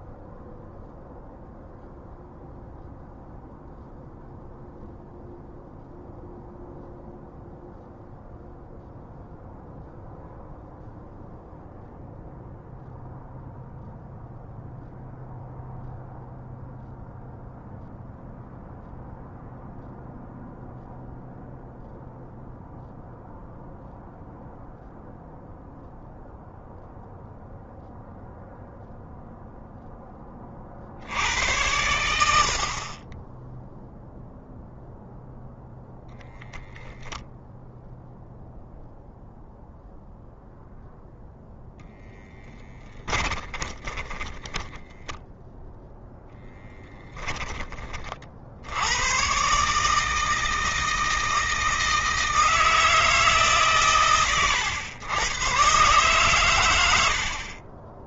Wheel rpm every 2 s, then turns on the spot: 0, 0, 0, 0, 0, 0, 0, 0, 0, 0, 0, 0, 0, 0, 0, 60, 40, 0, 0, 0, 0, 20, 10, 10, 100, 160, 160, 110, 90.
42-46